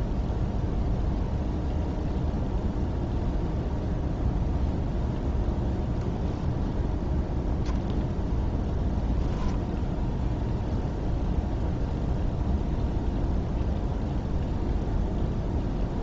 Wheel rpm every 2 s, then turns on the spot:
0, 0, 0, 0, 0, 0, 0, 0.
none